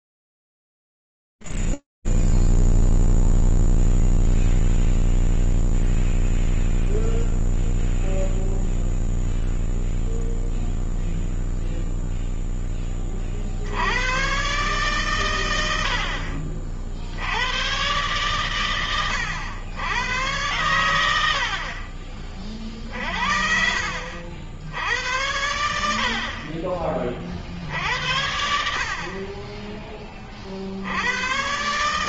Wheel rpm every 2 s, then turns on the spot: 0, 0, 0, 0, 0, 0, 0, 70, 90, 110, 100, 60, 60, 70, 70, 50.
none